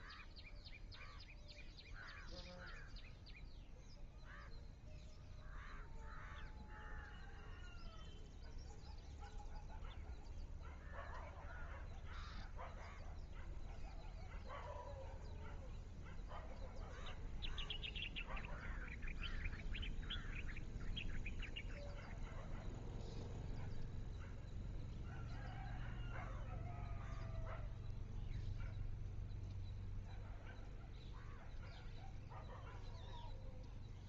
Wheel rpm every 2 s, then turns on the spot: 0, 0, 0, 0, 0, 0, 0, 0, 0, 0, 0, 0, 0, 0, 0, 0, 0.
none